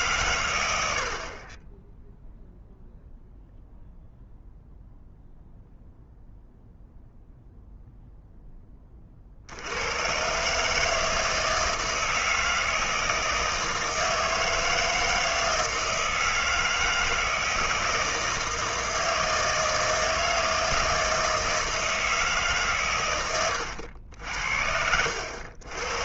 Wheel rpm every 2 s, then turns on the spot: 100, 0, 0, 0, 10, 150, 160, 160, 160, 160, 160, 140, 70.
none